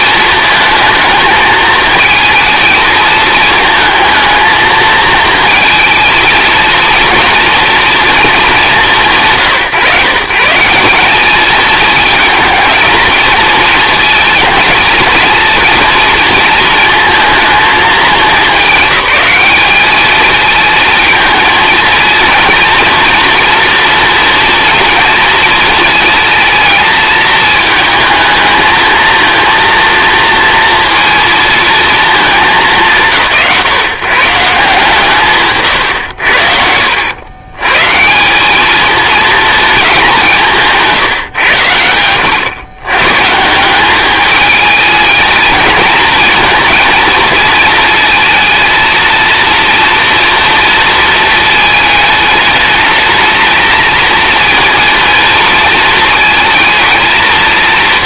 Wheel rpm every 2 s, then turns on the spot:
220, 220, 220, 230, 200, 170, 220, 220, 230, 210, 220, 240, 240, 220, 220, 230, 200, 150, 70, 220, 160, 110, 220, 230, 230, 230, 220, 230, 220.
none